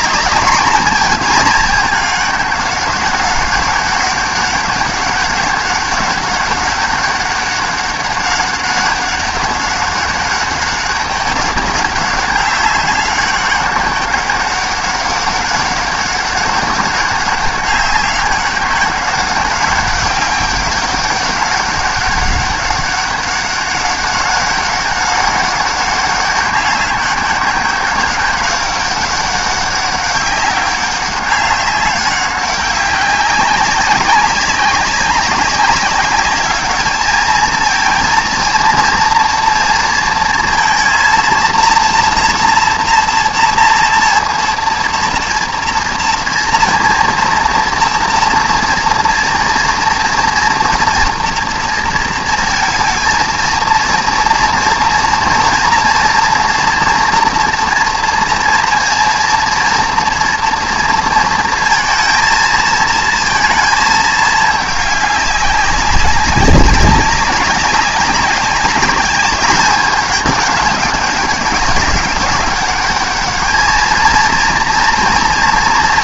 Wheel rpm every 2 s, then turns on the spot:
210, 200, 200, 200, 200, 200, 200, 200, 200, 200, 200, 200, 200, 200, 200, 200, 200, 200, 210, 230, 230, 230, 230, 230, 240, 240, 230, 230, 230, 230, 230, 230, 210, 200, 200, 200, 200, 230.
none